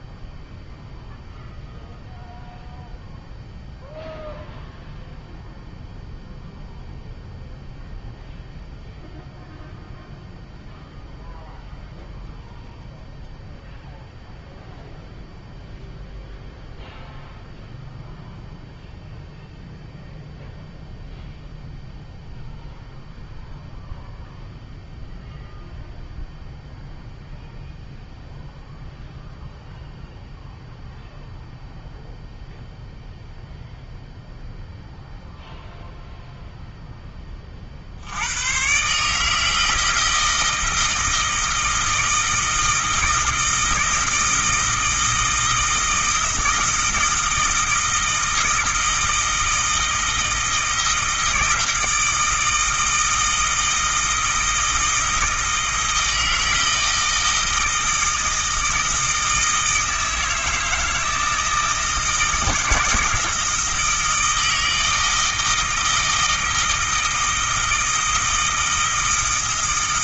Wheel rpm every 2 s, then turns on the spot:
0, 0, 0, 0, 0, 0, 0, 0, 0, 0, 0, 0, 0, 0, 0, 0, 0, 0, 0, 130, 160, 160, 160, 170, 160, 160, 160, 160, 160, 160, 160, 160, 160, 160, 160.
none